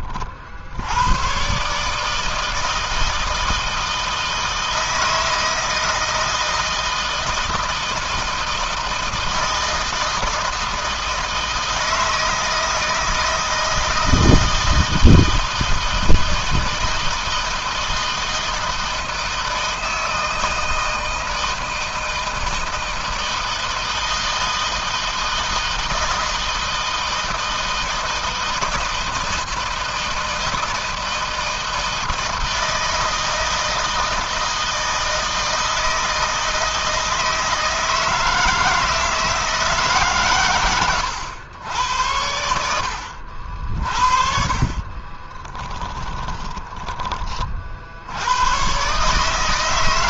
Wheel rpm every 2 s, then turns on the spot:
80, 160, 160, 160, 160, 160, 160, 160, 160, 160, 160, 160, 160, 160, 160, 160, 160, 160, 160, 160, 120, 80, 40, 30, 130.
44-48